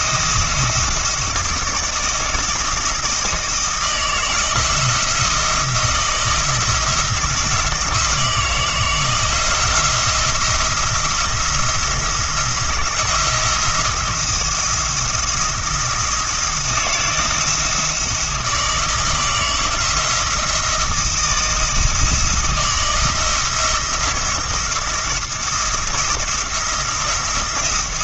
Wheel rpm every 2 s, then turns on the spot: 170, 160, 170, 170, 170, 170, 170, 170, 170, 170, 160, 160, 170, 170.
none